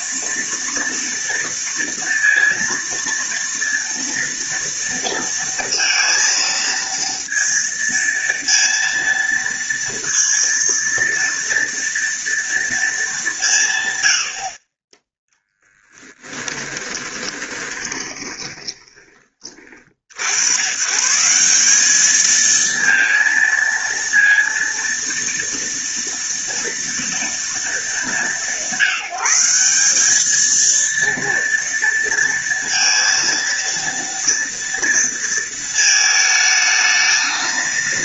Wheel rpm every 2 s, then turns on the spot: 230, 230, 230, 230, 230, 230, 230, 20, 20, 20, 120, 220, 230, 230, 180, 220, 230, 230, 220.
16-20